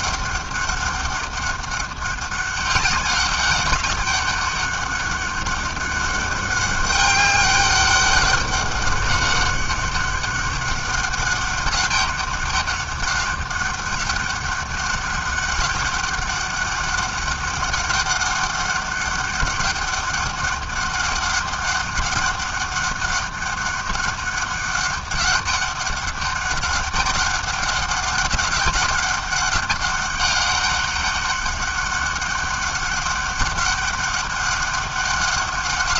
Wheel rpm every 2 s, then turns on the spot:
200, 200, 200, 200, 190, 200, 200, 200, 200, 200, 200, 200, 200, 200, 200, 200, 200, 200.
none